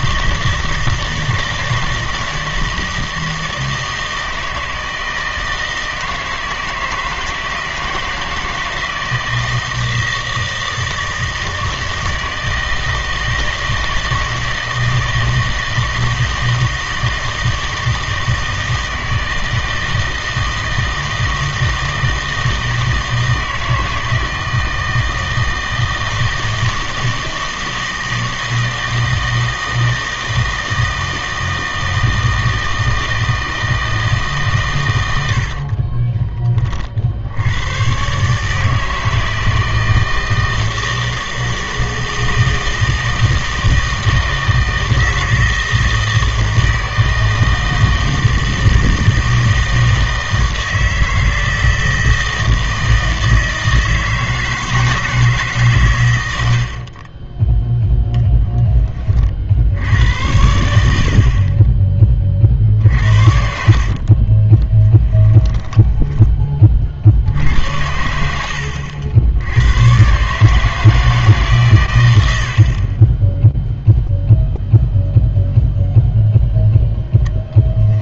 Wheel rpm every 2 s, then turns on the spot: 160, 160, 160, 160, 160, 160, 160, 160, 160, 160, 160, 160, 160, 160, 160, 160, 160, 120, 40, 150, 160, 160, 160, 160, 160, 160, 160, 160, 60, 10, 70, 50, 20, 40, 70, 150, 40, 0, 0.
56-58 62-66 68-70